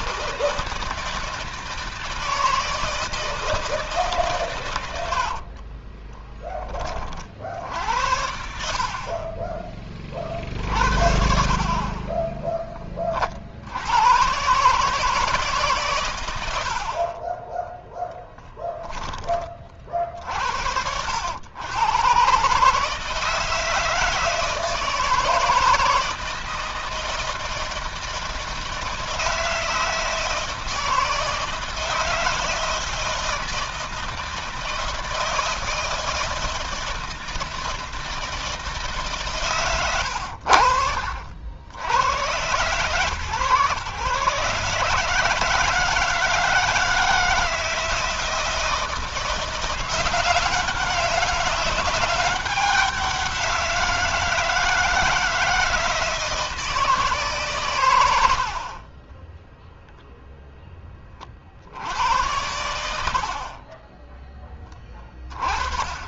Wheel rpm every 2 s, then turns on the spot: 160, 160, 130, 20, 70, 40, 20, 120, 100, 10, 60, 140, 160, 160, 160, 160, 160, 160, 160, 160, 80, 110, 140, 160, 160, 190, 190, 160, 160, 60, 10, 90, 10.
12-14